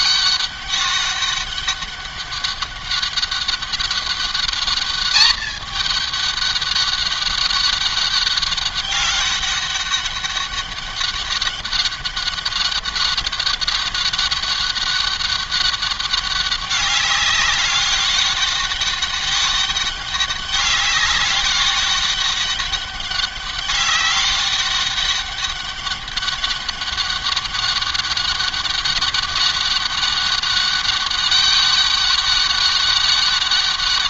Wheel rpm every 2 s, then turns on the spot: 200, 200, 210, 200, 200, 200, 200, 200, 200, 200, 190, 200, 200, 200, 200, 200, 200.
none